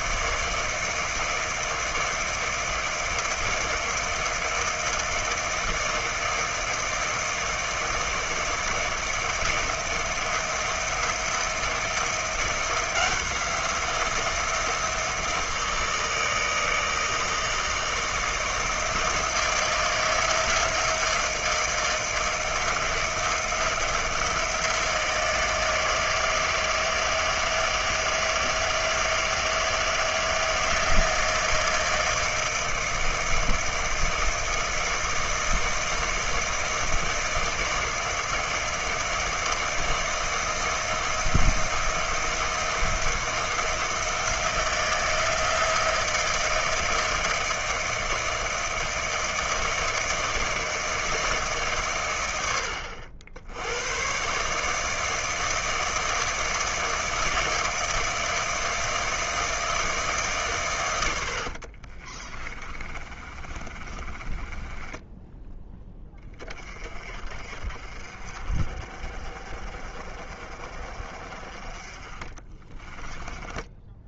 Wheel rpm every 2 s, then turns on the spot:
160, 160, 160, 160, 160, 170, 170, 170, 160, 160, 170, 160, 160, 160, 160, 160, 160, 160, 160, 160, 160, 170, 170, 160, 160, 160, 90, 150, 160, 160, 120, 30, 10, 30, 50, 40, 20.
62-66 72-74